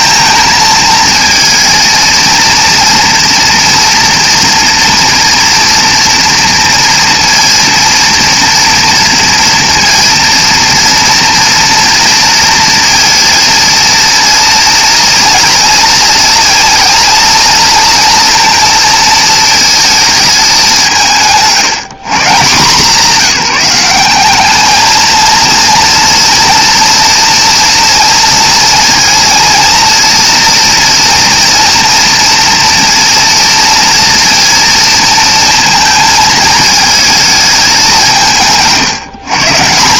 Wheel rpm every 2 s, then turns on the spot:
220, 230, 230, 230, 230, 230, 230, 230, 230, 230, 190, 160, 220, 240, 230, 230, 230, 230, 220, 160.
none